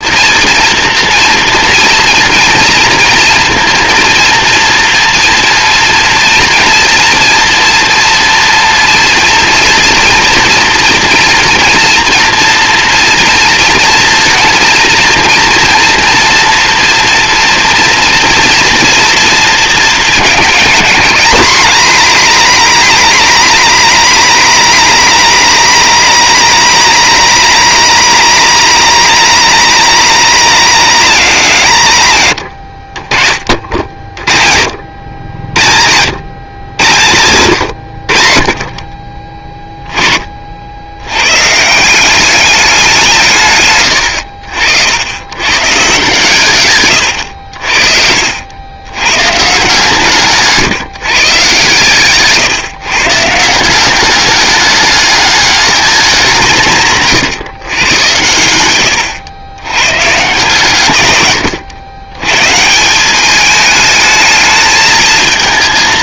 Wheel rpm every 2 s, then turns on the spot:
230, 230, 230, 230, 230, 230, 230, 240, 230, 230, 210, 220, 220, 210, 220, 190, 40, 60, 100, 40, 90, 170, 80, 110, 100, 150, 140, 210, 160, 110, 120, 180, 220.
56-58